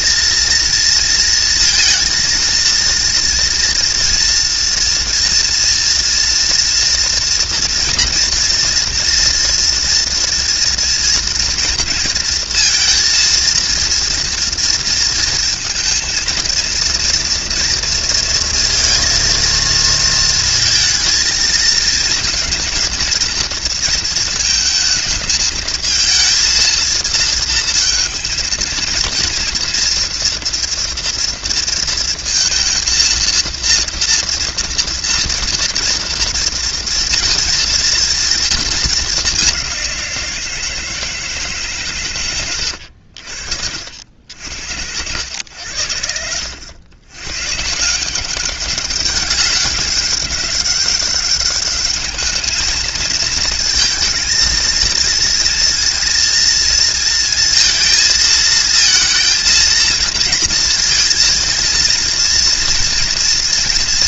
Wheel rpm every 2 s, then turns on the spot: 230, 230, 230, 230, 240, 230, 230, 230, 230, 230, 220, 230, 220, 230, 230, 230, 230, 230, 230, 210, 160, 90, 70, 90, 200, 200, 220, 230, 230, 220, 230, 230.
42-44